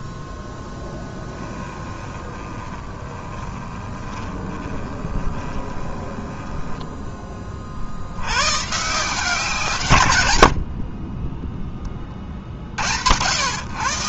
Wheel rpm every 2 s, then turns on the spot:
0, 20, 20, 10, 140, 70, 70.
2-6 10-12